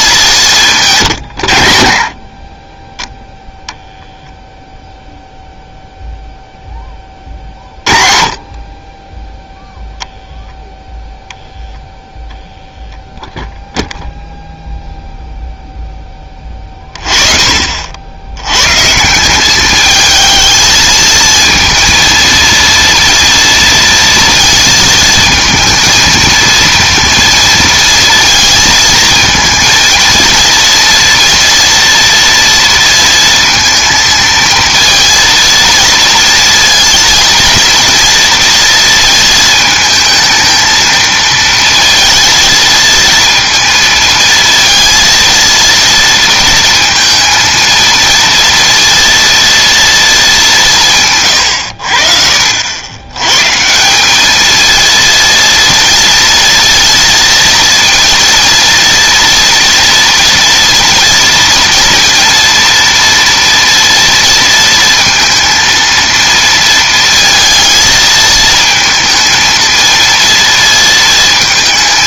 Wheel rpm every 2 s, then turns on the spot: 170, 20, 0, 10, 30, 0, 0, 0, 30, 120, 220, 230, 230, 230, 230, 230, 230, 230, 230, 230, 220, 230, 230, 230, 230, 170, 90, 230, 230, 230, 230, 230, 230, 230, 220, 230.
none